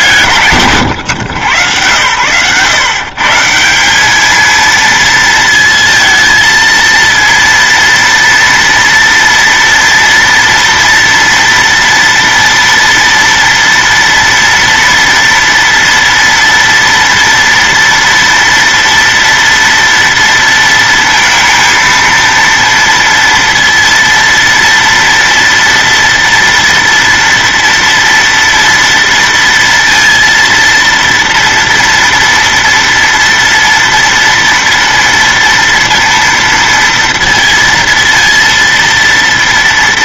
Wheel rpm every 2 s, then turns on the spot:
130, 130, 230, 230, 230, 230, 230, 240, 230, 230, 230, 230, 230, 230, 230, 230, 230, 230, 230, 230.
none